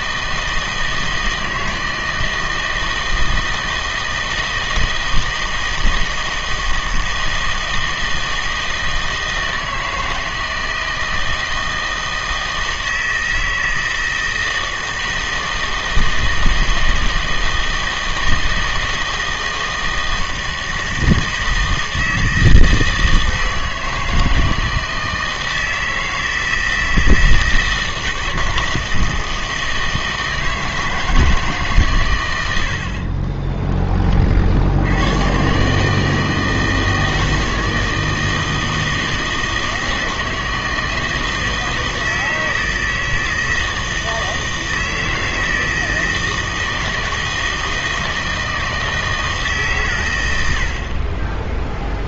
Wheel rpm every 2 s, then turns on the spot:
160, 160, 160, 160, 160, 160, 160, 160, 160, 160, 160, 160, 160, 160, 160, 160, 70, 80, 160, 160, 160, 160, 160, 160, 160, 70.
32-34